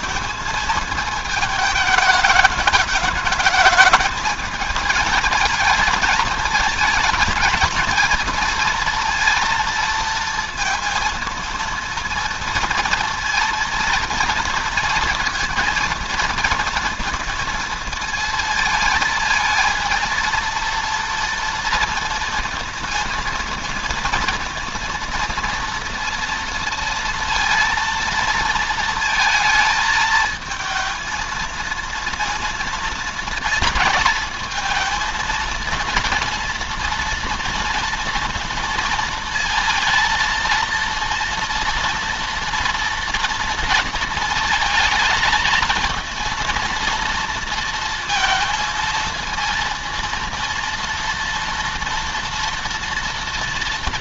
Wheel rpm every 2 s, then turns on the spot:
220, 210, 220, 220, 230, 230, 230, 230, 230, 220, 230, 230, 230, 230, 230, 230, 230, 220, 230, 230, 230, 230, 220, 230, 230, 230, 230.
none